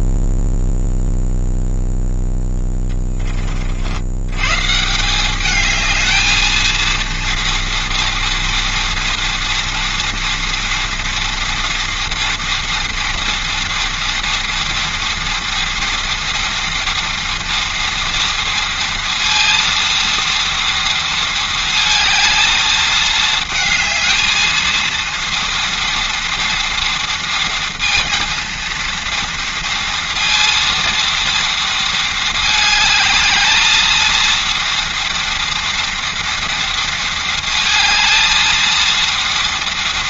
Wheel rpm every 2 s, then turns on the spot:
0, 20, 180, 230, 230, 230, 240, 230, 240, 230, 230, 220, 230, 230, 230, 230, 220, 230, 230, 230.
none